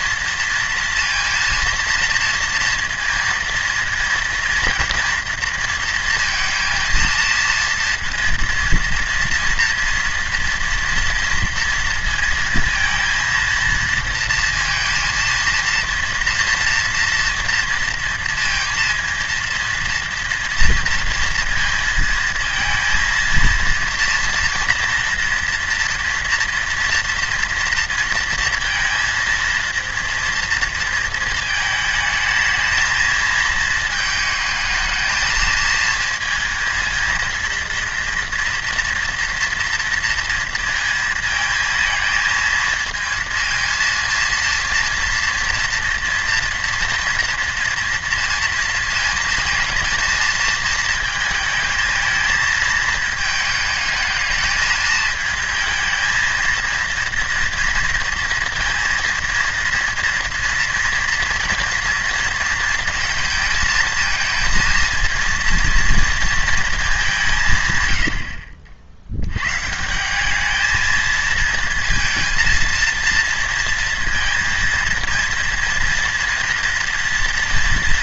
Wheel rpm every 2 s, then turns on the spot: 230, 230, 230, 230, 230, 230, 230, 230, 230, 230, 230, 230, 230, 230, 230, 230, 220, 220, 230, 230, 230, 220, 230, 230, 230, 220, 220, 220, 230, 230, 230, 230, 220, 230, 70, 210, 230, 230, 230.
68-70